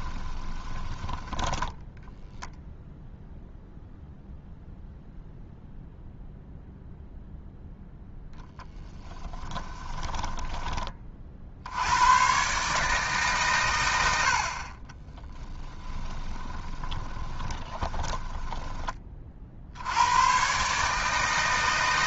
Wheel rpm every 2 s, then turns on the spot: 10, 0, 0, 0, 10, 20, 150, 40, 20, 20, 150.
0-2 8-10 14-18